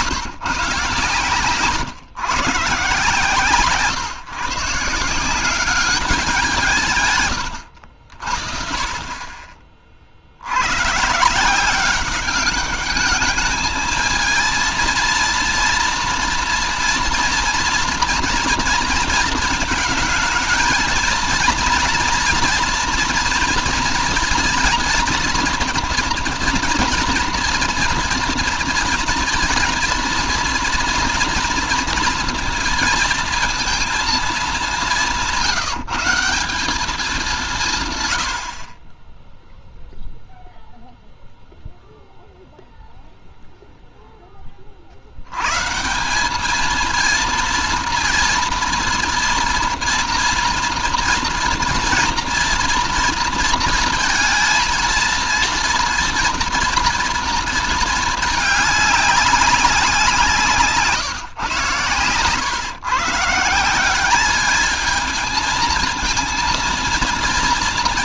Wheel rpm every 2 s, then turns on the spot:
140, 140, 160, 140, 40, 120, 210, 230, 230, 230, 220, 230, 230, 230, 230, 230, 230, 190, 200, 30, 0, 0, 50, 220, 230, 230, 230, 230, 230, 200, 140, 140, 220, 230.
none